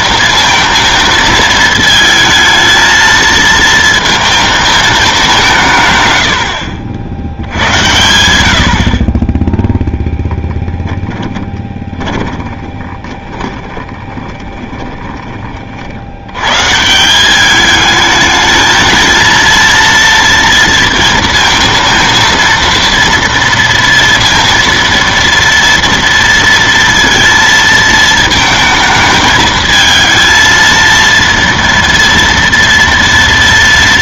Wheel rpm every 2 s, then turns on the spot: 230, 220, 220, 80, 80, 10, 20, 20, 130, 220, 230, 230, 230, 230, 220, 230, 230.
10-16